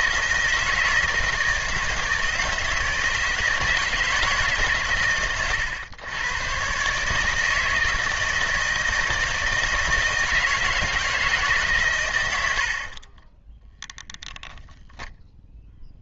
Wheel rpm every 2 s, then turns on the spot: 160, 160, 140, 120, 160, 160, 70, 0.
none